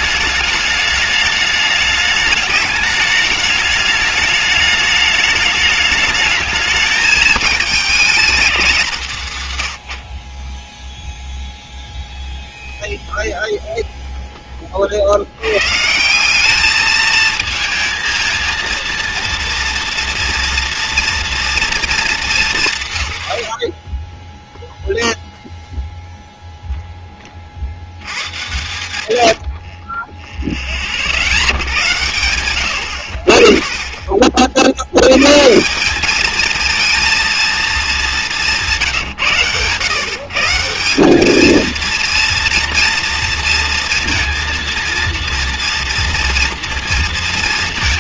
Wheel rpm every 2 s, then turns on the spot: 220, 210, 210, 220, 150, 0, 0, 60, 220, 230, 230, 120, 0, 10, 110, 60, 60, 100, 230, 160, 190, 230, 230, 230.
none